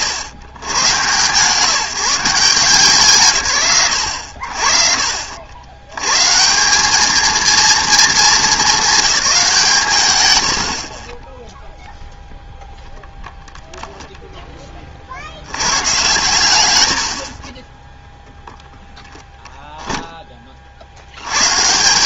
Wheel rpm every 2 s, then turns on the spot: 110, 150, 50, 200, 190, 60, 0, 20, 100, 0, 60.
none